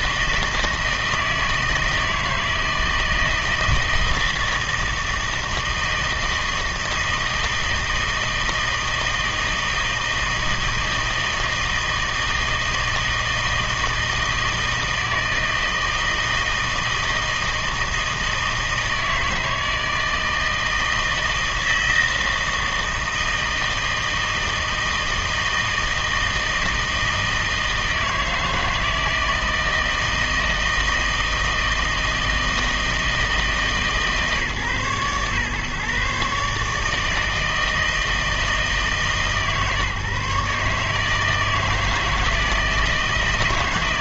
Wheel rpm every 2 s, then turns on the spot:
160, 160, 160, 160, 160, 160, 160, 160, 160, 160, 160, 160, 160, 160, 160, 160, 160, 140, 150, 160, 150, 160.
none